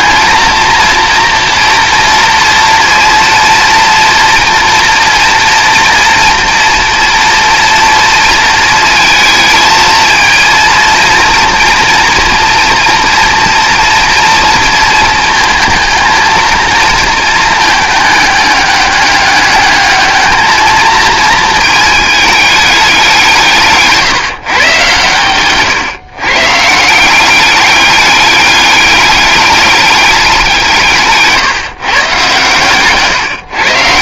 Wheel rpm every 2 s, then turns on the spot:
230, 230, 230, 240, 230, 230, 230, 230, 230, 200, 220, 200, 130, 160, 200, 170, 130.
32-34